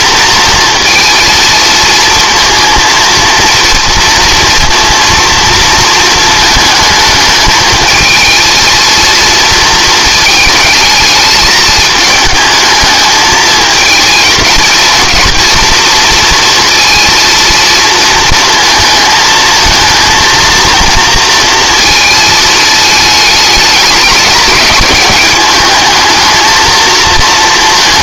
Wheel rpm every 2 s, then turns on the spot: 230, 230, 230, 220, 220, 220, 220, 220, 230, 230, 230, 220, 210, 220.
none